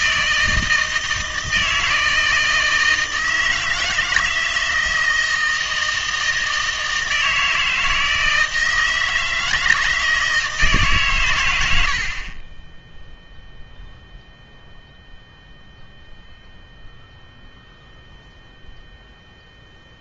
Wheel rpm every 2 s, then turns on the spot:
160, 160, 160, 160, 160, 150, 10, 0, 0, 0.
none